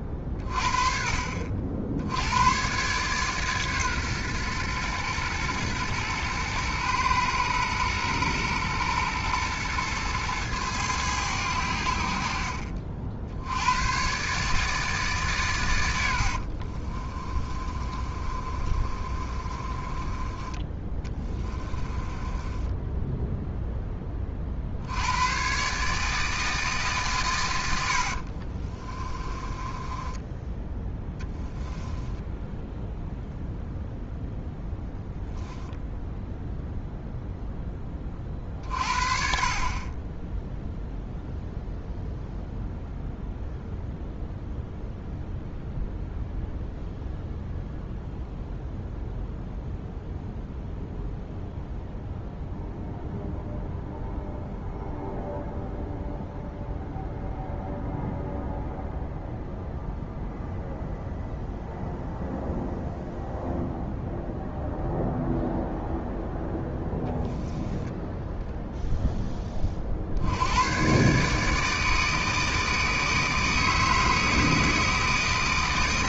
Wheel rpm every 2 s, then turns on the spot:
30, 100, 120, 120, 120, 110, 60, 140, 70, 30, 20, 20, 40, 160, 50, 10, 0, 0, 0, 40, 10, 0, 0, 0, 0, 0, 0, 0, 0, 0, 0, 0, 0, 0, 0, 80, 160, 150.
16-20 22-24 28-32